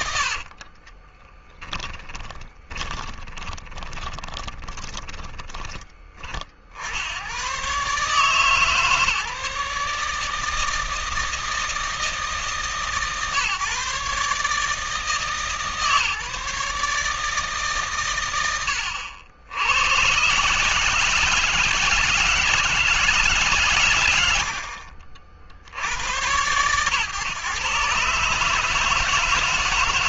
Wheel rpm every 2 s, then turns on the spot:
40, 20, 20, 60, 150, 160, 140, 150, 150, 80, 150, 160, 60, 110, 160.
0-6